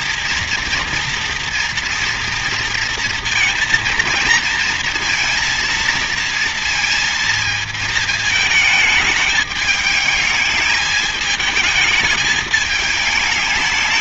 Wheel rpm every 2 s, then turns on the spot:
230, 230, 230, 230, 220, 210, 220.
none